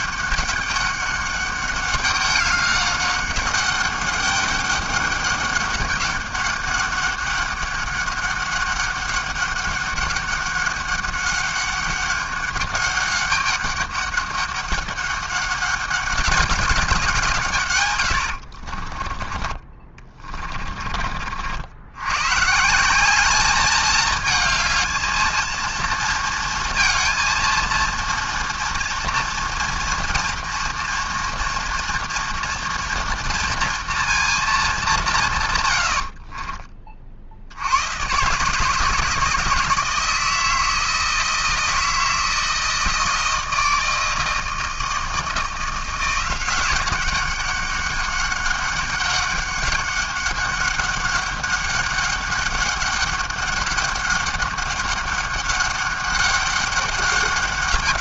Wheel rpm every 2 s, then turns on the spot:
200, 200, 200, 200, 200, 200, 200, 200, 200, 60, 30, 140, 220, 230, 230, 230, 240, 210, 30, 150, 160, 160, 160, 180, 190, 200, 200, 200, 200.
18-22 36-38